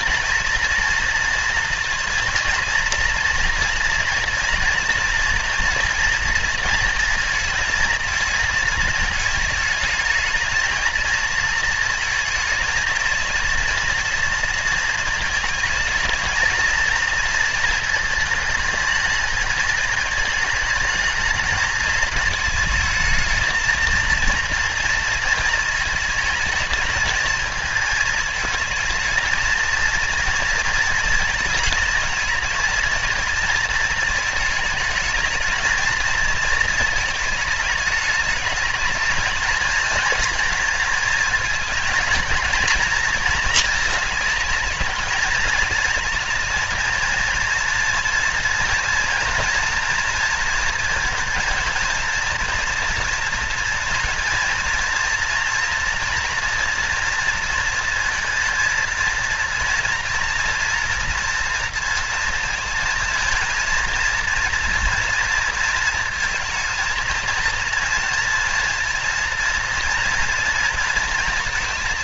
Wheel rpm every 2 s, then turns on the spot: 230, 230, 230, 220, 220, 220, 220, 230, 220, 220, 210, 220, 230, 220, 220, 230, 220, 220, 220, 220, 220, 230, 220, 230, 230, 230, 230, 230, 230, 230, 230, 230, 230, 220, 230, 230.
none